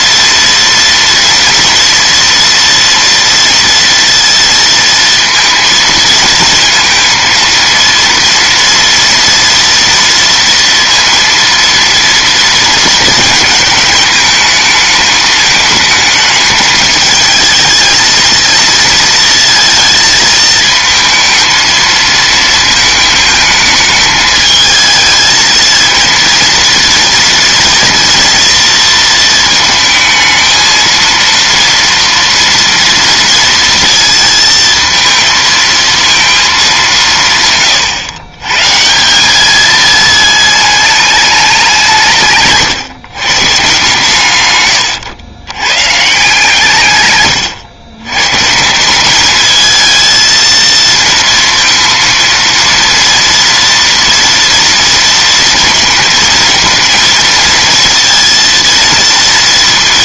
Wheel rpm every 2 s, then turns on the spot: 230, 230, 230, 230, 230, 230, 230, 220, 220, 220, 220, 220, 220, 230, 230, 220, 230, 230, 220, 130, 220, 140, 110, 150, 140, 220, 230, 230, 220, 230.
none